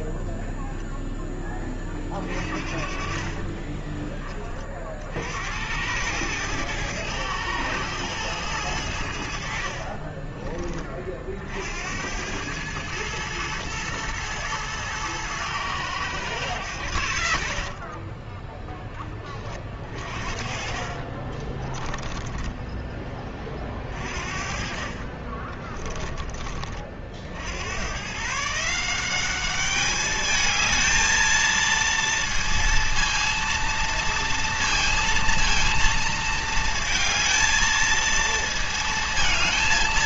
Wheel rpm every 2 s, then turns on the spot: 0, 40, 30, 110, 100, 30, 100, 110, 110, 20, 40, 10, 40, 30, 150, 210, 230, 230, 220, 220.
2-4 18-26